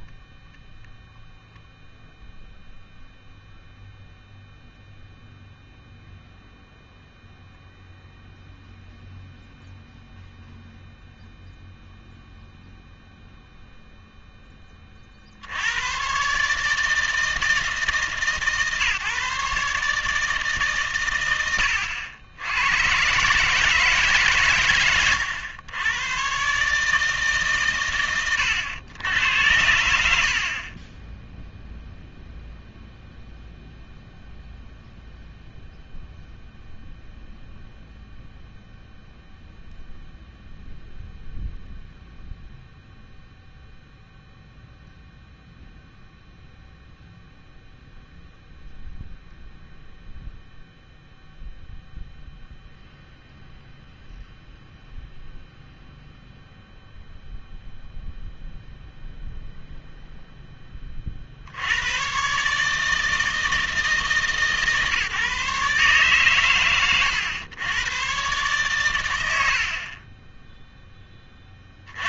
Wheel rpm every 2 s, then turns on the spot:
0, 0, 0, 0, 0, 0, 0, 20, 150, 140, 140, 100, 120, 150, 100, 20, 0, 0, 0, 0, 0, 0, 0, 0, 0, 0, 0, 0, 0, 0, 20, 150, 150, 110, 110, 0.
none